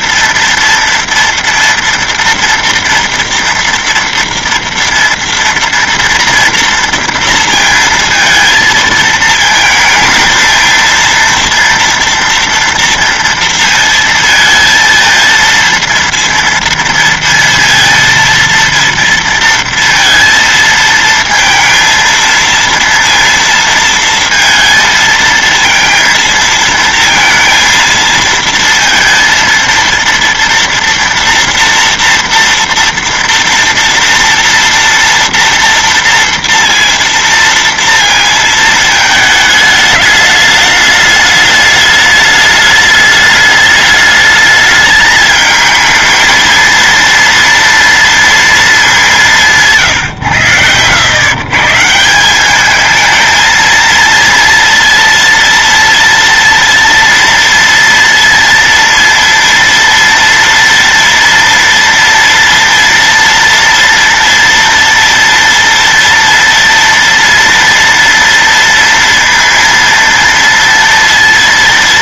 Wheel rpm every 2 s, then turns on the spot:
230, 230, 230, 230, 230, 230, 230, 220, 230, 230, 220, 230, 230, 230, 230, 230, 230, 230, 230, 220, 210, 210, 210, 230, 220, 100, 200, 230, 230, 230, 230, 230, 230, 230, 230, 230.
none